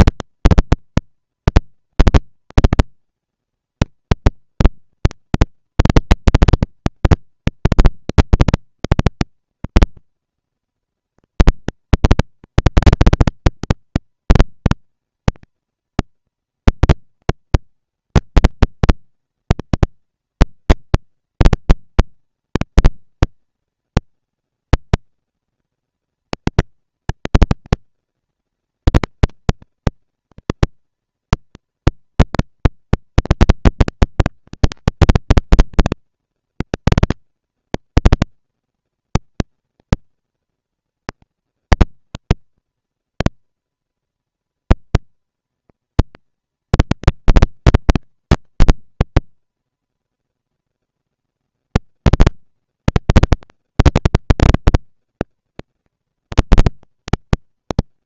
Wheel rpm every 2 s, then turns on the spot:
230, 230, 230, 230, 230, 230, 230, 230, 230, 200, 190, 210, 220, 230, 220, 230, 230, 230, 230, 230, 220, 230, 230, 230, 240, 240, 230, 230, 230.
none